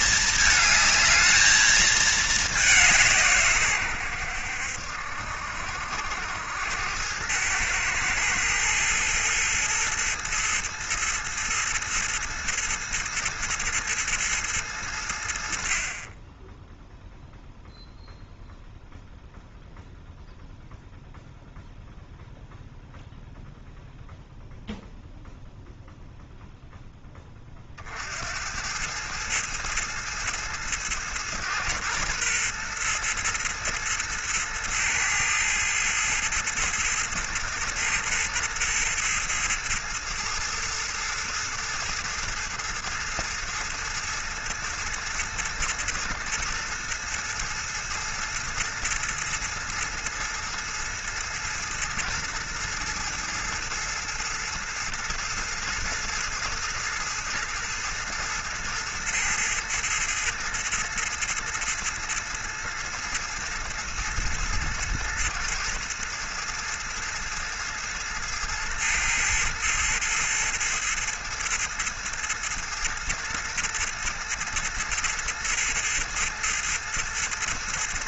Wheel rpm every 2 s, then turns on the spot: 210, 190, 70, 90, 110, 110, 110, 100, 10, 0, 0, 0, 0, 0, 90, 110, 120, 110, 110, 110, 110, 110, 110, 110, 110, 110, 110, 110, 110, 110, 120, 110, 110, 110, 110, 110, 110, 110, 110.
none